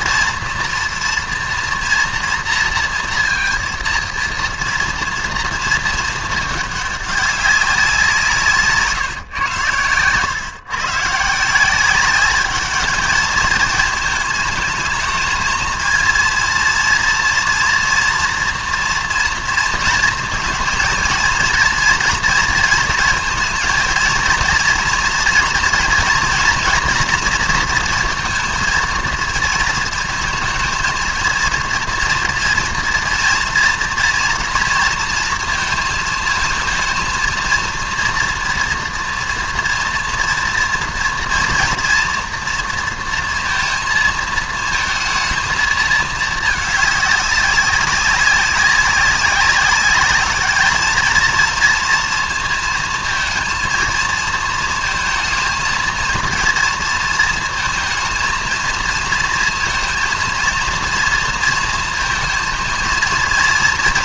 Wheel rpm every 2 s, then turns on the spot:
230, 240, 230, 220, 180, 110, 190, 220, 230, 230, 230, 230, 220, 230, 230, 230, 230, 230, 230, 230, 230, 230, 230, 220, 200, 200, 230, 230, 230, 230, 230, 230.
none